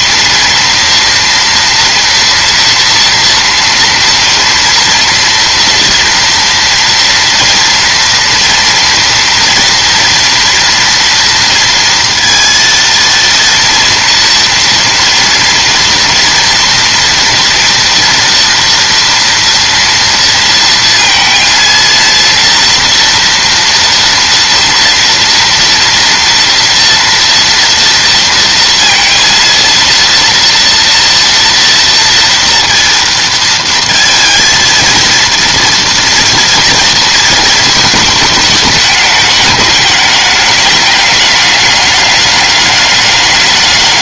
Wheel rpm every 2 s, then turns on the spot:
230, 230, 230, 230, 230, 230, 230, 230, 230, 230, 230, 230, 230, 230, 230, 230, 230, 230, 230, 210, 210, 200.
none